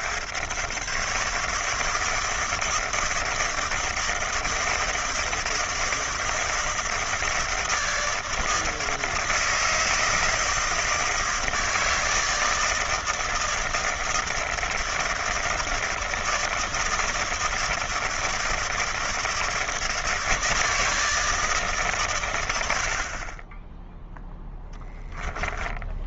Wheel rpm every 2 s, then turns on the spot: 130, 160, 160, 160, 160, 160, 160, 160, 160, 160, 160, 80, 10.
24-26